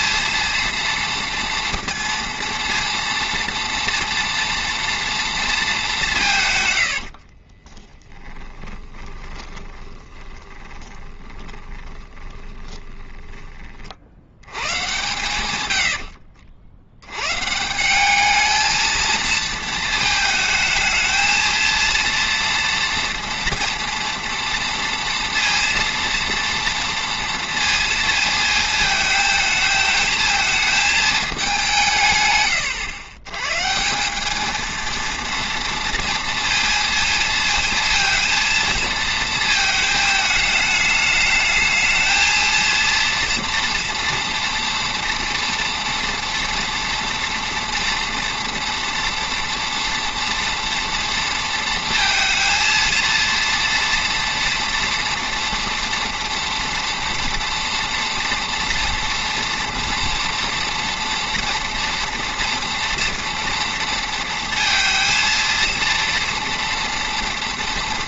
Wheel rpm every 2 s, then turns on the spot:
230, 230, 230, 150, 30, 20, 20, 100, 70, 220, 220, 230, 230, 230, 220, 220, 120, 220, 230, 230, 210, 220, 230, 240, 240, 230, 230, 230, 230, 240, 240, 230, 230, 230.
8-14